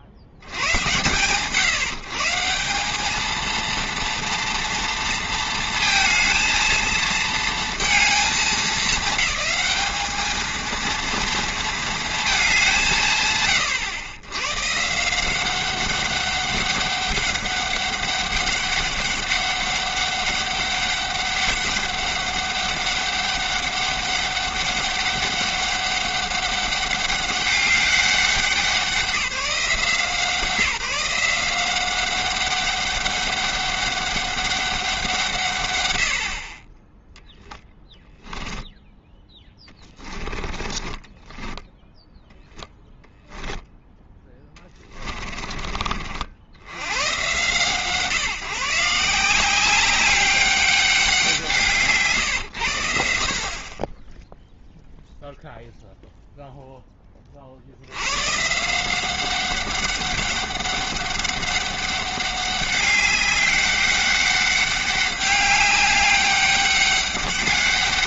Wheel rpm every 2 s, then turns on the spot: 50, 190, 230, 230, 210, 230, 180, 140, 190, 200, 200, 200, 200, 200, 190, 180, 190, 190, 40, 10, 20, 0, 20, 60, 150, 200, 100, 0, 0, 170, 200, 190, 200, 200.
40-42 44-46